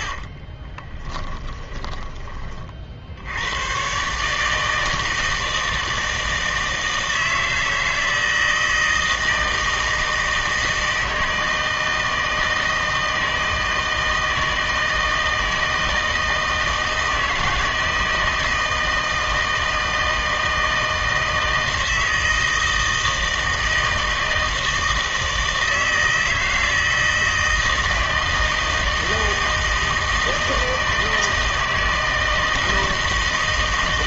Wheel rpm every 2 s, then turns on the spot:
30, 30, 160, 160, 160, 160, 160, 160, 160, 160, 160, 160, 160, 160, 160, 160, 160.
0-2